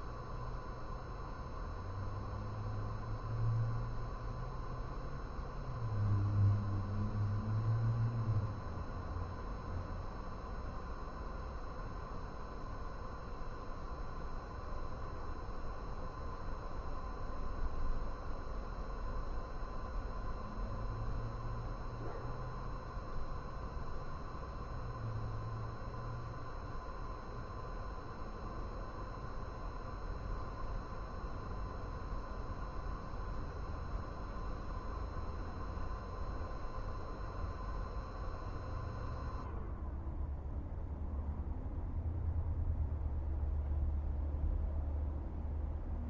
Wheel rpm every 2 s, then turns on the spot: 0, 0, 0, 0, 0, 0, 0, 0, 0, 0, 0, 0, 0, 0, 0, 0, 0, 0, 0, 0, 0, 0, 0.
none